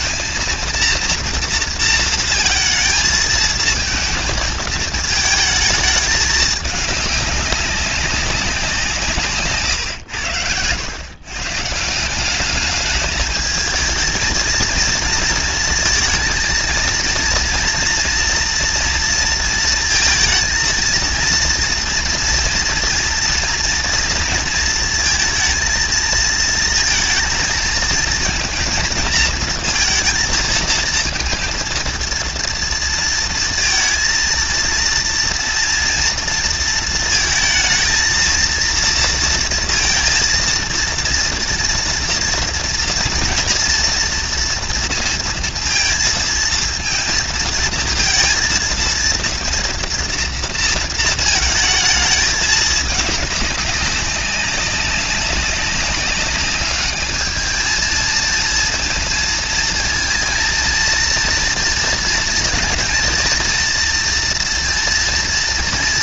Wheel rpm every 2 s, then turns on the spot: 230, 220, 220, 210, 180, 110, 210, 230, 230, 240, 230, 230, 220, 230, 230, 230, 230, 230, 230, 230, 230, 230, 230, 230, 220, 230, 210, 200, 200, 230, 230, 230, 230.
none